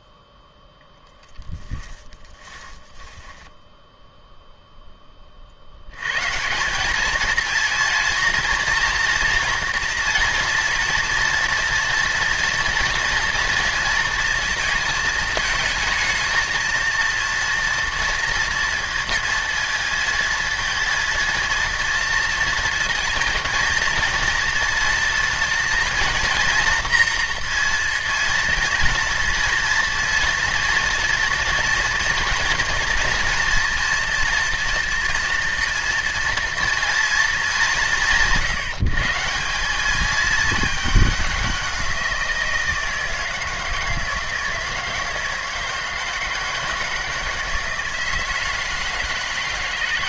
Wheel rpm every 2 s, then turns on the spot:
0, 10, 10, 210, 230, 230, 230, 230, 230, 230, 230, 220, 230, 230, 230, 230, 230, 230, 230, 140, 210, 160, 160, 160, 160.
2-4